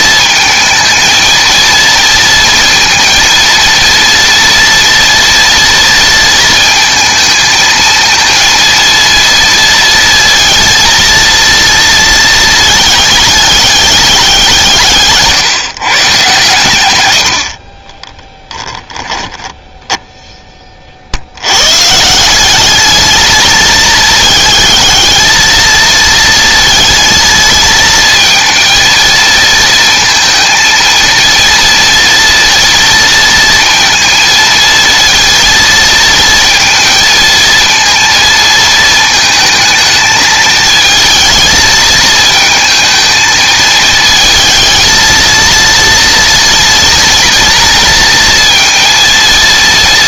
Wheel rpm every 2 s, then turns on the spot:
230, 230, 230, 220, 230, 230, 210, 150, 50, 10, 80, 220, 220, 220, 230, 230, 230, 230, 230, 220, 220, 220, 230, 230, 230.
18-20